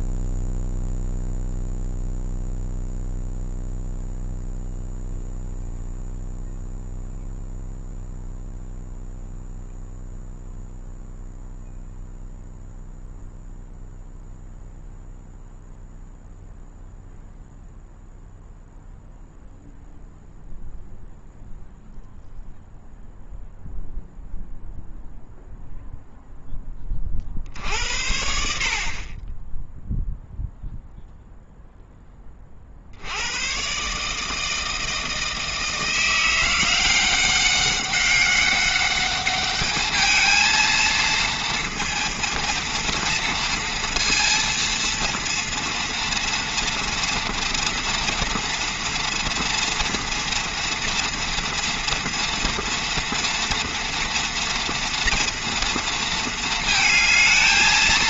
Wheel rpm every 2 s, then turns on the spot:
0, 0, 0, 0, 0, 0, 0, 0, 0, 0, 0, 0, 0, 10, 60, 0, 40, 160, 170, 200, 230, 240, 230, 230, 230, 240, 230, 230, 220.
none